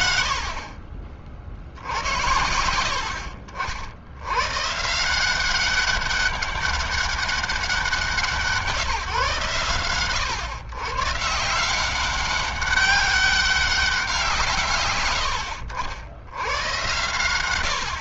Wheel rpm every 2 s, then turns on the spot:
50, 70, 140, 200, 160, 130, 190, 130, 110.
none